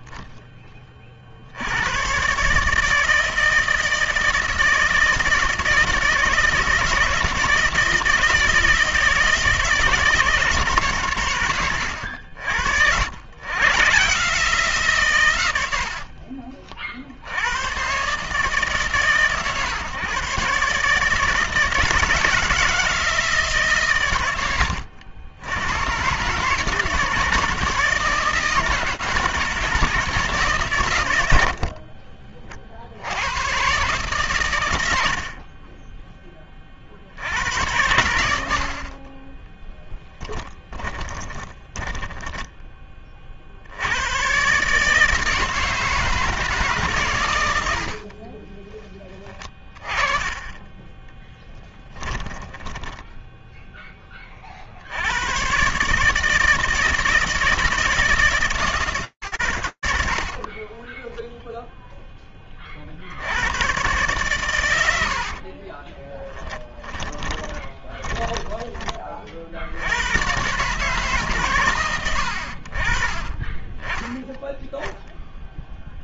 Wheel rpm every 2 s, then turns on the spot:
10, 140, 160, 160, 160, 150, 70, 150, 50, 140, 140, 160, 110, 150, 160, 120, 70, 80, 70, 30, 20, 30, 150, 140, 20, 10, 10, 80, 160, 130, 10, 70, 70, 20, 50, 130, 20, 0.
40-42 48-54 60-62 66-68